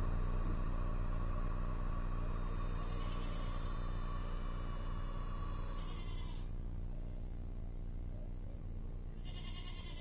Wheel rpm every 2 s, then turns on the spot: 0, 0, 0, 0, 0.
none